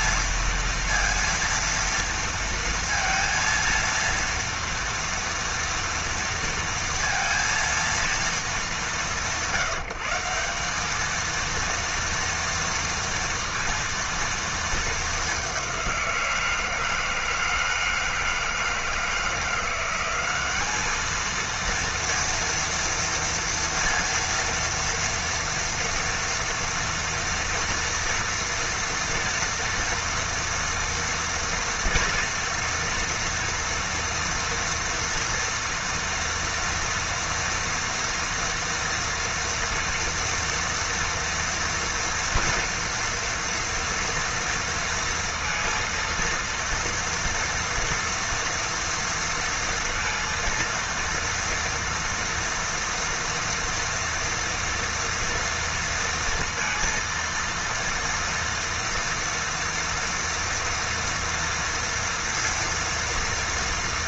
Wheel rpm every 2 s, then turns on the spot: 230, 230, 230, 230, 190, 200, 230, 220, 170, 160, 210, 230, 230, 230, 230, 230, 230, 230, 230, 230, 230, 230, 230, 230, 230, 230, 230, 230, 230, 230, 240, 230.
none